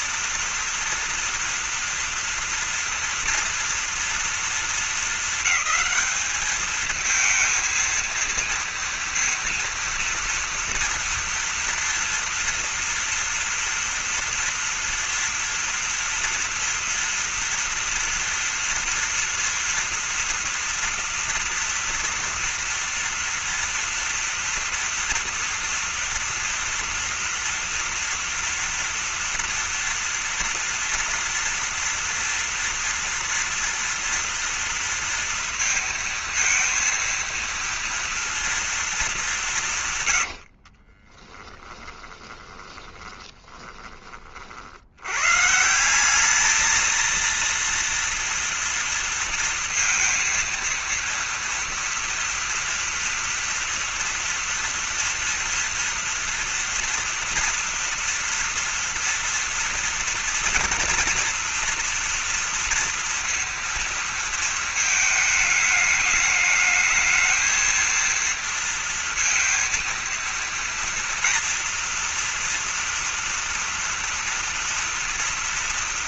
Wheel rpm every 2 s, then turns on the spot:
230, 230, 220, 220, 230, 240, 240, 230, 230, 230, 230, 230, 230, 230, 230, 230, 230, 230, 230, 230, 60, 20, 60, 210, 230, 230, 230, 230, 230, 230, 230, 230, 230, 210, 230, 230, 230, 230.
40-44